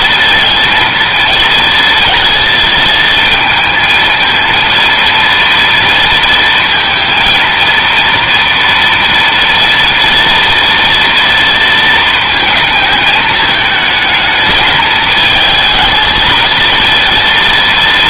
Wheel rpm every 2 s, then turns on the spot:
230, 230, 230, 230, 240, 230, 230, 220, 220.
none